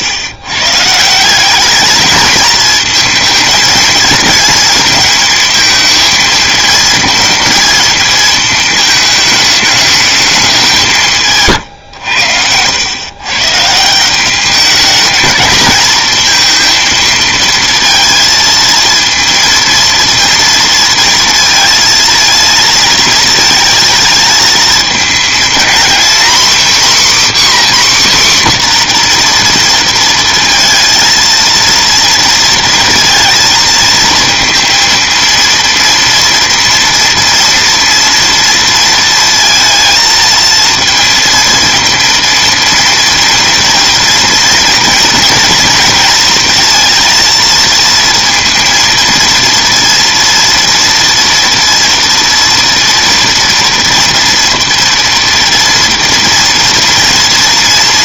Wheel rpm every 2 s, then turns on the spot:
140, 220, 230, 230, 220, 190, 100, 210, 220, 220, 230, 230, 230, 270, 260, 230, 230, 230, 230, 230, 230, 230, 230, 230, 230, 230, 230, 230, 230.
none